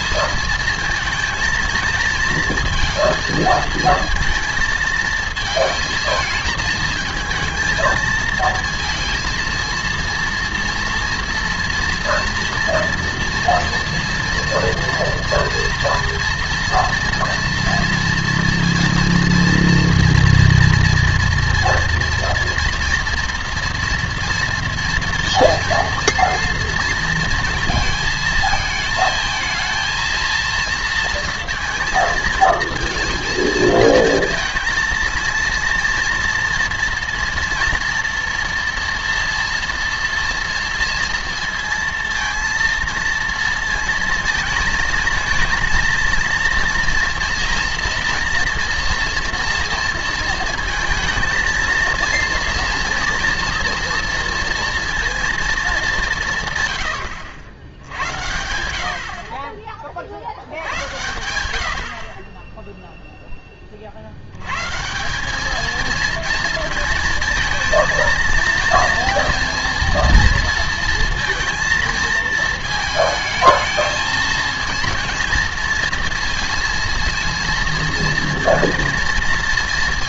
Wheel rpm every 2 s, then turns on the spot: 220, 230, 230, 220, 230, 230, 230, 230, 230, 240, 230, 230, 240, 230, 220, 230, 220, 230, 230, 240, 230, 230, 220, 230, 240, 230, 230, 230, 140, 80, 90, 10, 120, 230, 230, 230, 230, 230, 230, 230.
none